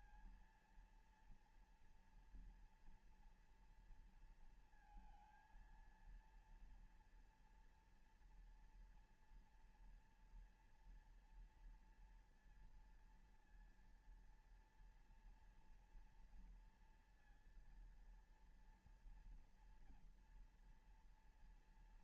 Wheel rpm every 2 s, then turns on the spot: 230, 230, 230, 230, 240, 230, 230, 230, 230, 230, 240.
none